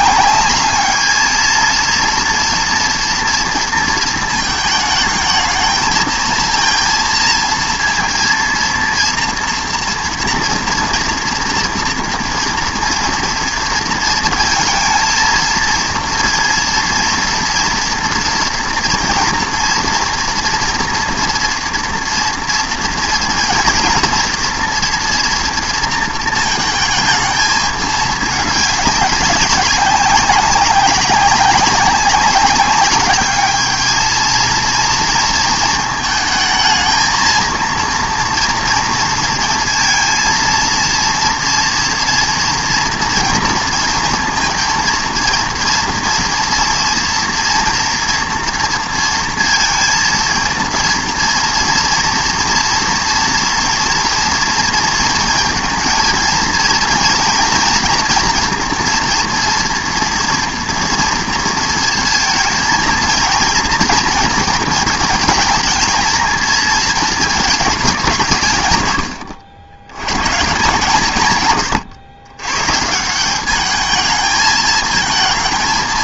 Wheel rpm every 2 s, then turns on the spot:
210, 230, 220, 230, 230, 230, 230, 230, 230, 230, 230, 230, 230, 220, 200, 200, 200, 230, 220, 230, 230, 230, 230, 230, 230, 230, 230, 230, 230, 230, 240, 220, 220, 230, 140, 150, 120, 220.
none